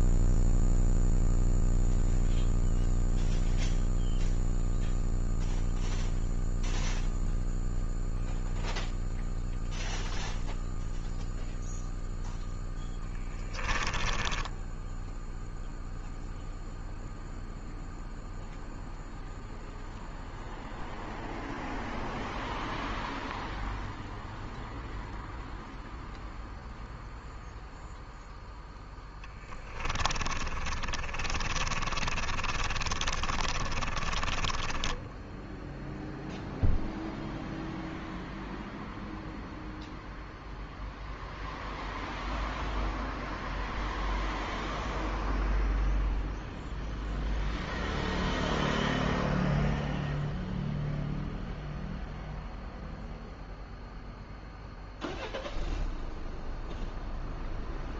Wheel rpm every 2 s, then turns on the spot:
10, 0, 0, 0, 0, 0, 10, 10, 0, 0, 0, 0, 0, 0, 10, 30, 30, 10, 0, 0, 0, 0, 0, 0, 0, 0, 0, 0, 0.
0-2 12-16 28-36